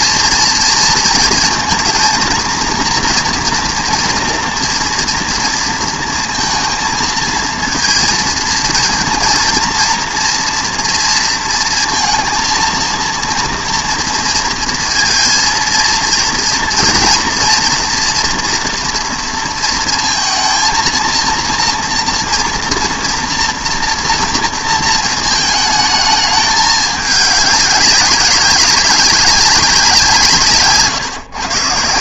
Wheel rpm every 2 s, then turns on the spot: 230, 230, 230, 230, 230, 230, 230, 230, 240, 230, 220, 230, 230, 210, 200, 140.
none